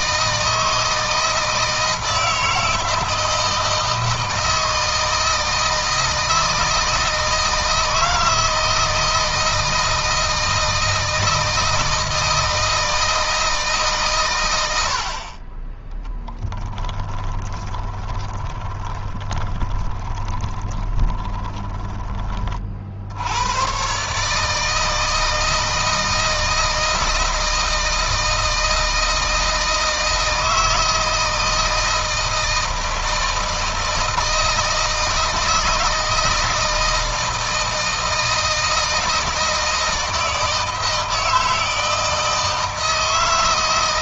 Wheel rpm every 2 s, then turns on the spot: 160, 160, 160, 160, 160, 160, 160, 70, 30, 20, 20, 50, 160, 160, 160, 160, 160, 160, 160, 160, 160, 160.
16-22